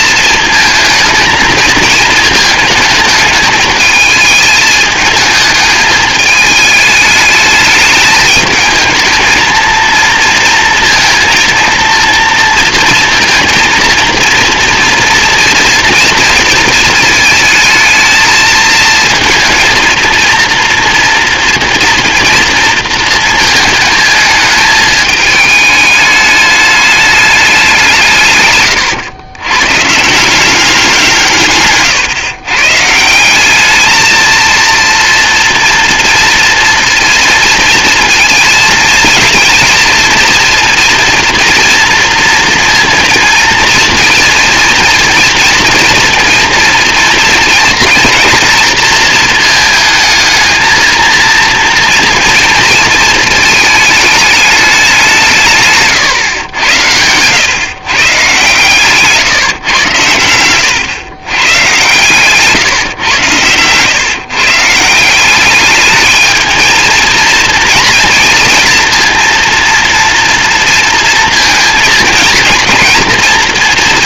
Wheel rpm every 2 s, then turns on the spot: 220, 220, 210, 210, 220, 230, 230, 230, 230, 220, 230, 230, 220, 210, 120, 190, 150, 230, 230, 230, 240, 230, 230, 230, 230, 230, 230, 200, 100, 130, 100, 140, 150, 220, 230, 230, 230.
none